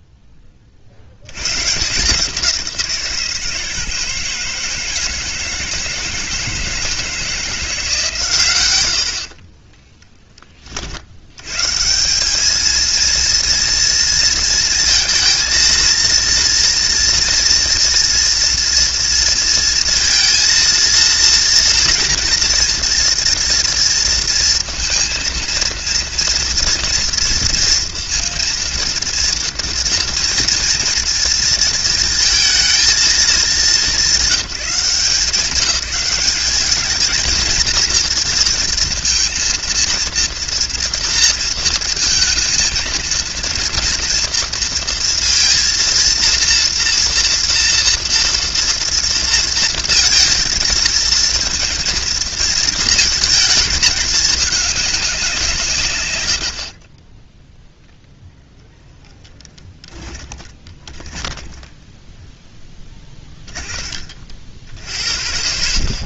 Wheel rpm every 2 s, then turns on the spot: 70, 160, 160, 160, 70, 90, 230, 230, 240, 230, 230, 230, 230, 230, 230, 230, 210, 180, 230, 230, 230, 230, 230, 240, 230, 220, 220, 180, 10, 10, 20, 20, 60.
58-64